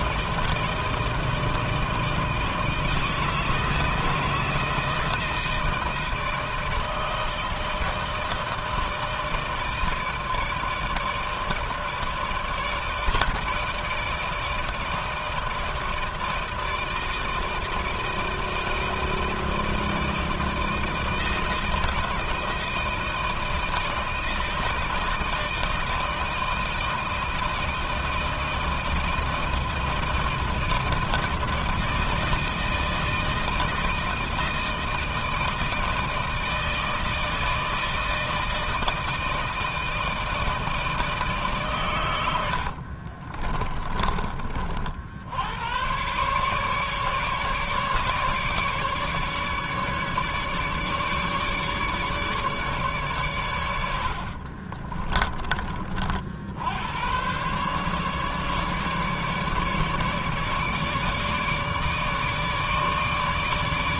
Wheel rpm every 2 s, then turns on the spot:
160, 160, 160, 160, 160, 160, 160, 160, 160, 160, 160, 160, 160, 160, 160, 160, 160, 160, 160, 160, 160, 50, 50, 140, 150, 150, 140, 40, 100, 150, 150, 150.
42-44 54-56